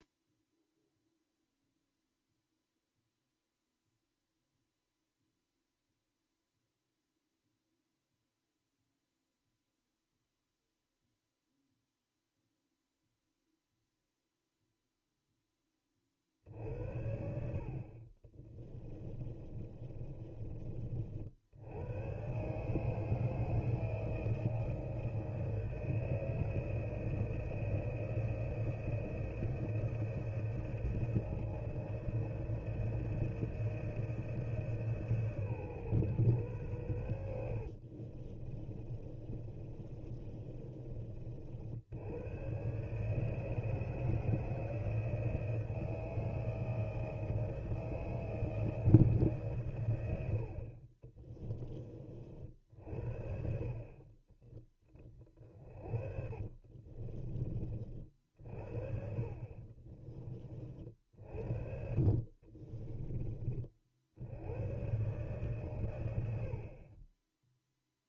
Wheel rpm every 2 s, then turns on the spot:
0, 0, 0, 0, 0, 0, 0, 0, 40, 30, 30, 130, 160, 160, 160, 160, 160, 160, 120, 40, 30, 110, 160, 160, 160, 90, 40, 20, 50, 50, 30, 40, 80, 80.
18-22 38-42 56-58 62-64